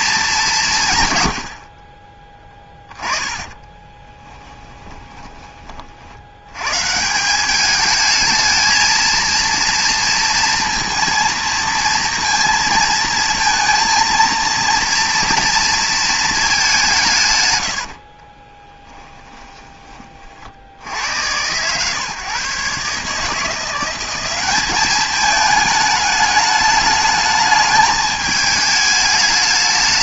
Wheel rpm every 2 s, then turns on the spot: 170, 10, 10, 110, 220, 230, 230, 230, 210, 20, 70, 140, 200, 210, 210.
4-6 18-20